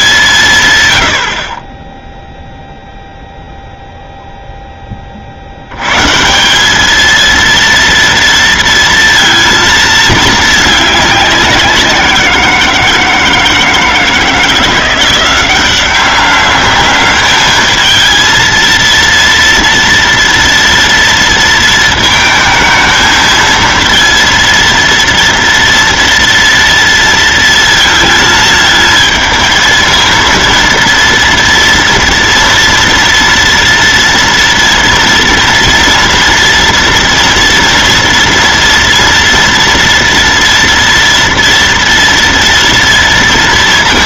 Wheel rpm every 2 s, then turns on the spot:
130, 0, 20, 210, 230, 200, 160, 170, 200, 230, 230, 220, 230, 230, 220, 230, 230, 230, 230, 240, 230, 230.
none